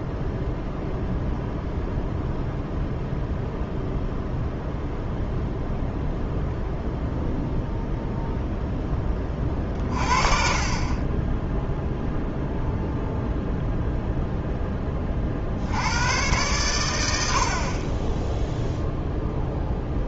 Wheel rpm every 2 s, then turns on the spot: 0, 0, 0, 0, 10, 30, 0, 10, 90, 0.
none